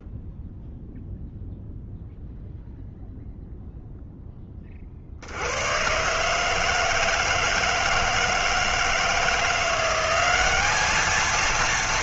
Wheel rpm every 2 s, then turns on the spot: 0, 0, 30, 160, 160, 200.
none